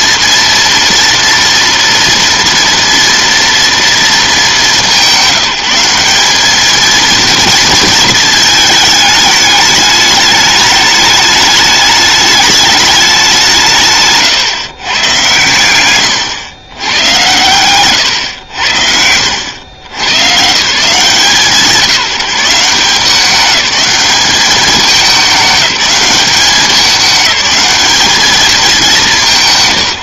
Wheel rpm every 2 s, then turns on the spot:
230, 230, 200, 220, 220, 210, 210, 130, 120, 90, 130, 170, 200, 200, 200.
none